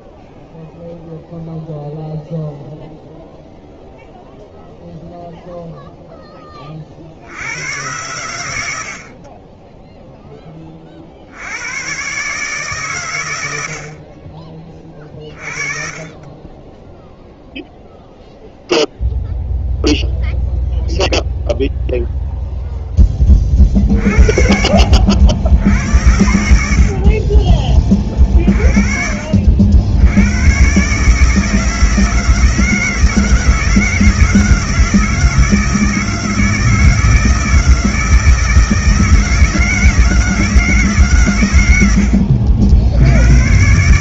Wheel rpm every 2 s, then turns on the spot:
0, 0, 0, 100, 20, 110, 60, 30, 0, 0, 0, 50, 90, 40, 90, 160, 160, 160, 160, 160, 80, 140.
12-14